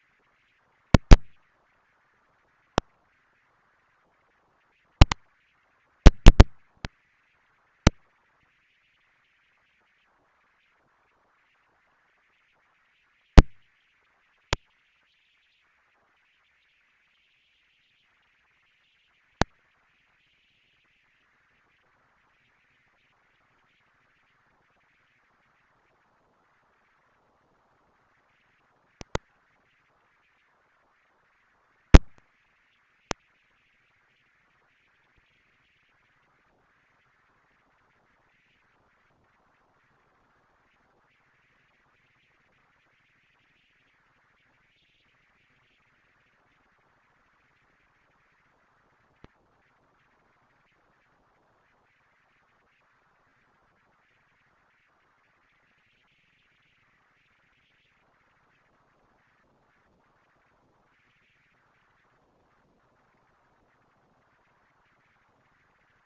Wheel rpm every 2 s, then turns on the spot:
230, 230, 230, 230, 230, 210, 220, 220, 230, 220, 230, 230, 230, 220, 230, 220, 210, 220, 230, 230, 230, 230, 230, 230, 210, 160, 100, 130, 190, 220, 220, 230, 230.
none